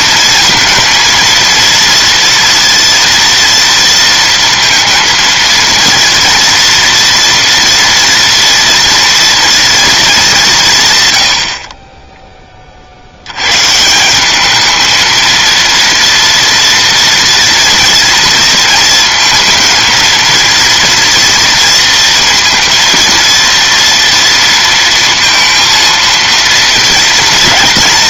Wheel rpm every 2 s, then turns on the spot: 230, 230, 230, 230, 230, 200, 20, 200, 230, 230, 230, 230, 230, 230.
none